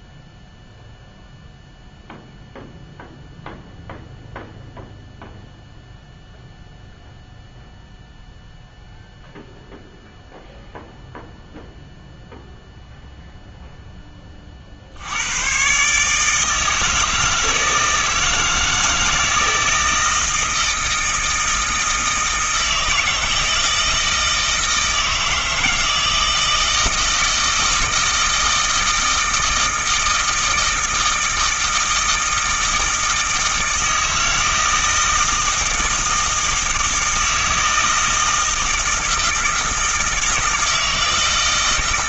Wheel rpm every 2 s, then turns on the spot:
0, 0, 0, 0, 0, 0, 0, 70, 160, 160, 160, 160, 160, 160, 160, 160, 160, 160, 160, 160, 160.
none